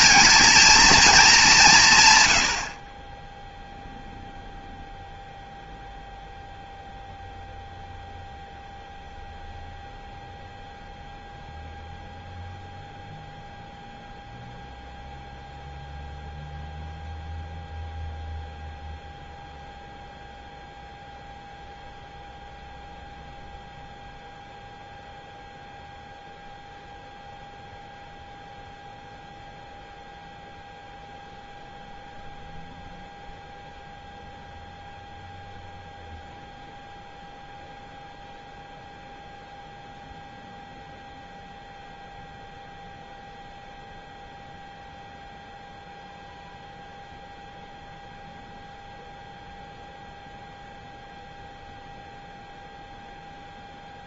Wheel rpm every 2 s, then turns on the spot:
230, 60, 0, 0, 0, 0, 0, 0, 0, 0, 0, 0, 0, 0, 0, 0, 0, 0, 0, 0, 0, 0, 0, 0, 0, 0, 0.
none